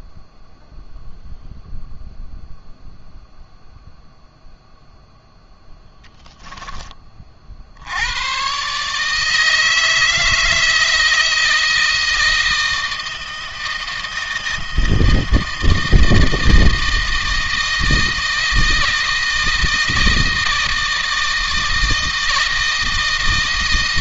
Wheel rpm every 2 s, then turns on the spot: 0, 0, 0, 30, 150, 160, 160, 160, 160, 160, 160, 160.
none